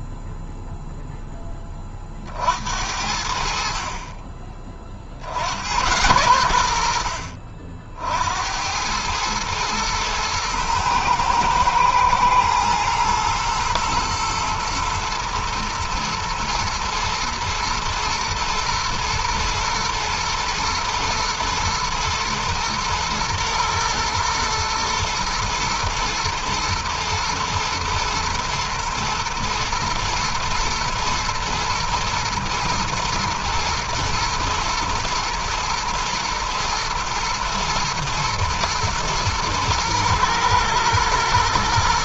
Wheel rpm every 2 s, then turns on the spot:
0, 50, 30, 100, 80, 110, 110, 110, 110, 110, 120, 110, 120, 110, 120, 120, 120, 120, 110, 120, 110.
none